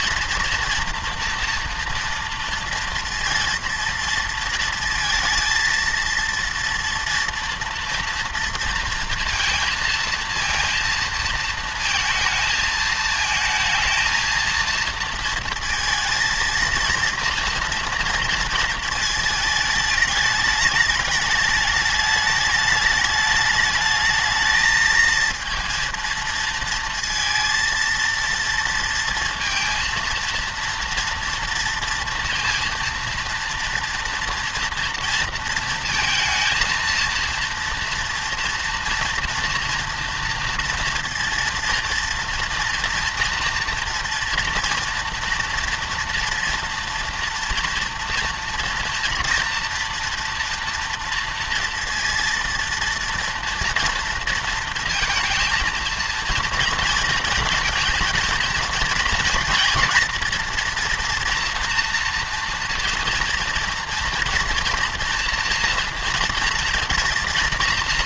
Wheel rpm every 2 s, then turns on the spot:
230, 230, 230, 230, 230, 230, 220, 230, 230, 230, 210, 210, 220, 230, 230, 230, 230, 230, 230, 230, 230, 230, 240, 230, 230, 230, 230, 230, 230, 230, 240, 230, 230, 230.
none